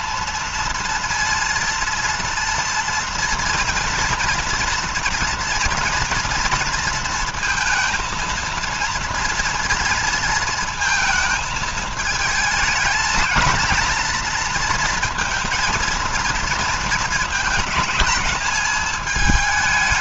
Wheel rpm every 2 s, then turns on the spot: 230, 230, 240, 230, 230, 230, 220, 240, 230, 210.
none